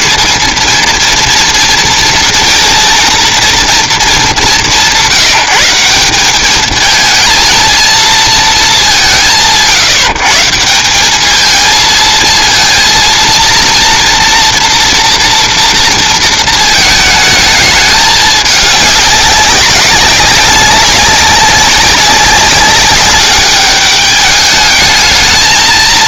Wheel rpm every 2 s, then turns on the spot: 210, 230, 180, 220, 210, 170, 230, 230, 220, 200, 200, 200, 210.
none